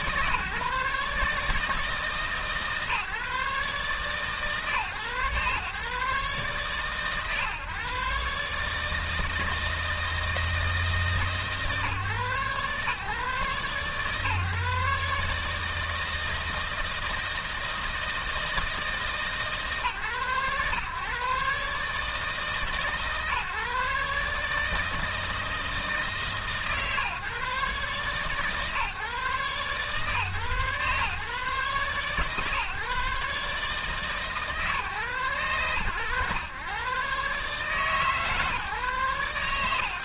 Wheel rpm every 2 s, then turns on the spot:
150, 150, 140, 130, 150, 160, 140, 150, 160, 160, 130, 140, 150, 140, 140, 140, 150, 120, 120, 140.
none